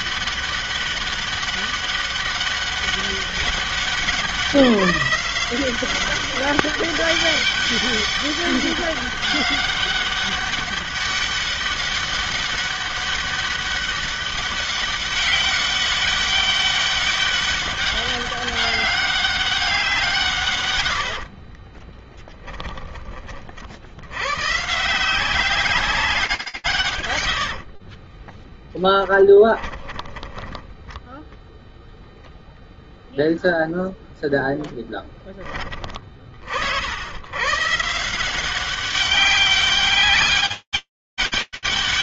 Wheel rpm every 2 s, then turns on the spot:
200, 200, 180, 200, 200, 200, 200, 200, 200, 200, 120, 10, 150, 80, 10, 0, 0, 10, 100, 190, 200.
20-22 26-30